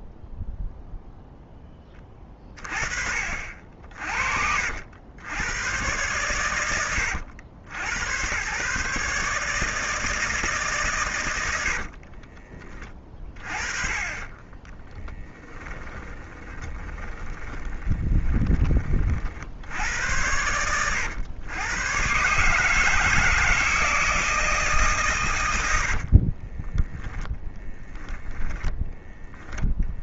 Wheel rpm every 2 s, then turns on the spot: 0, 40, 90, 80, 150, 120, 20, 20, 20, 30, 120, 160, 140, 10, 10.
12-18 26-28